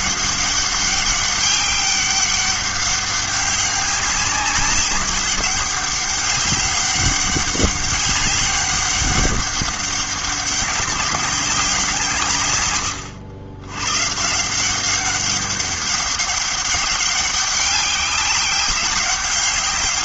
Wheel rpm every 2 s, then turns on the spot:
200, 200, 200, 200, 200, 190, 120, 180, 200, 200.
none